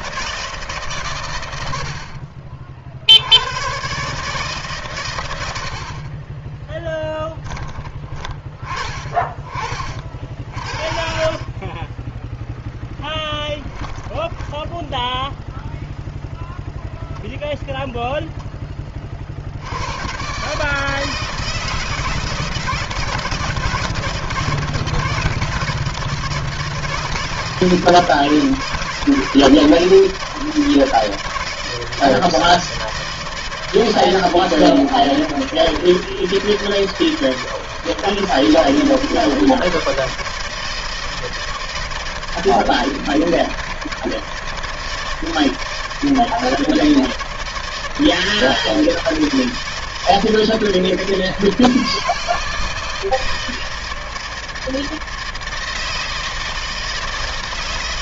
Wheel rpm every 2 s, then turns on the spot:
160, 50, 150, 30, 30, 40, 10, 10, 0, 10, 130, 150, 160, 160, 160, 160, 160, 160, 160, 160, 160, 160, 160, 160, 160, 160, 160, 160, 160.
none